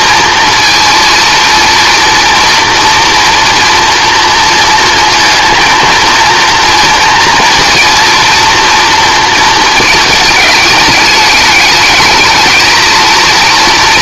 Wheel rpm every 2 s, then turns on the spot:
230, 240, 230, 230, 230, 210, 220.
none